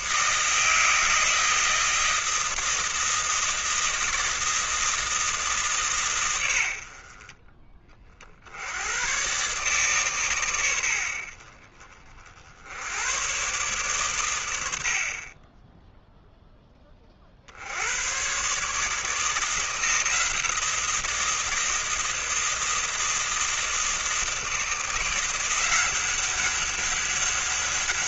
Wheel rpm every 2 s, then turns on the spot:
160, 160, 160, 60, 90, 90, 80, 60, 20, 150, 170, 160, 160, 200.
none